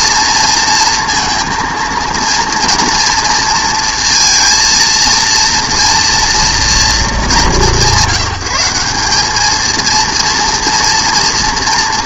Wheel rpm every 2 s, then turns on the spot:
230, 230, 230, 240, 180, 230.
none